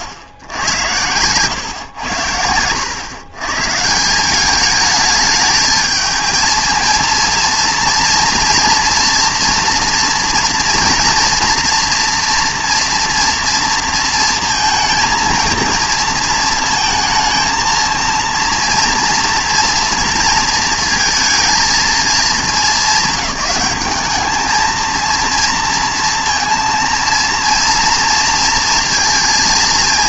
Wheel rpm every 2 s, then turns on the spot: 90, 90, 210, 230, 230, 230, 230, 230, 220, 230, 230, 200, 230, 230, 230.
none